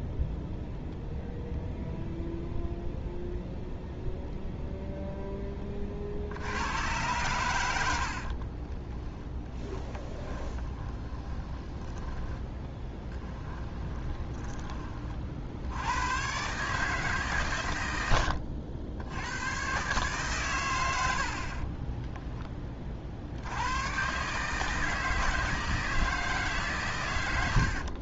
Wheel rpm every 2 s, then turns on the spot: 0, 0, 0, 110, 20, 20, 10, 30, 150, 80, 110, 30, 160, 140.
10-14